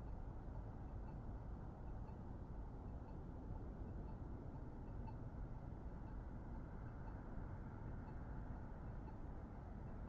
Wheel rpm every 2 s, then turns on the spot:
0, 0, 0, 0, 0.
none